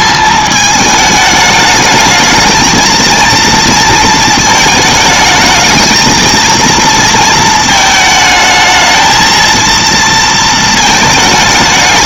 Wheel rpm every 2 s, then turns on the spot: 220, 230, 220, 230, 220, 220.
none